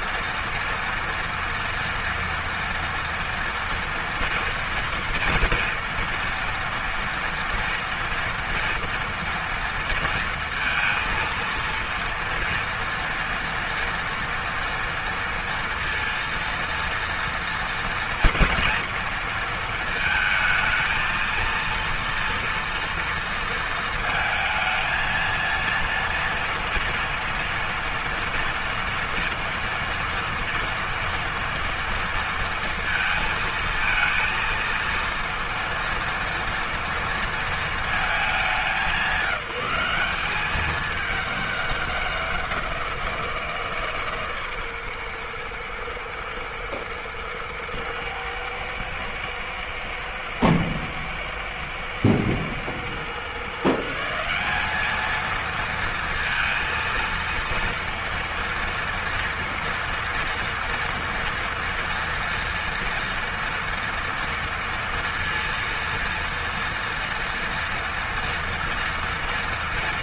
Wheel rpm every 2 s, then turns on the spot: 230, 230, 230, 230, 230, 230, 230, 230, 230, 230, 220, 230, 230, 230, 230, 230, 230, 230, 230, 200, 210, 170, 120, 110, 110, 110, 130, 220, 230, 230, 230, 230, 230, 230, 230.
none